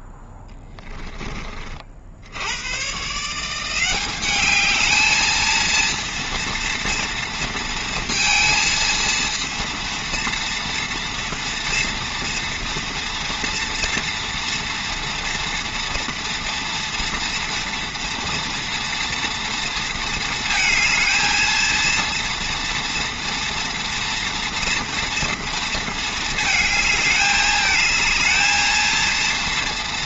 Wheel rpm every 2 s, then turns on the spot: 10, 120, 210, 230, 230, 230, 230, 230, 240, 230, 220, 230, 230, 220, 220.
none